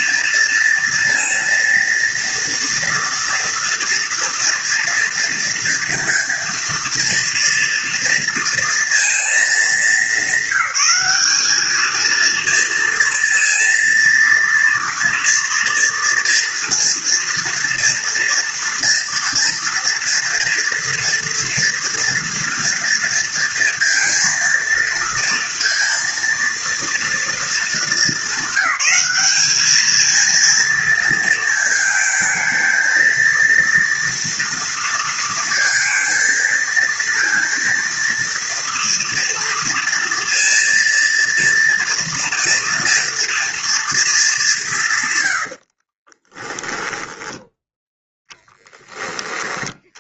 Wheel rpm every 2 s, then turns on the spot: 230, 230, 230, 230, 220, 200, 230, 230, 240, 240, 240, 230, 230, 230, 210, 230, 230, 230, 230, 230, 230, 230, 100, 20, 30.
46-48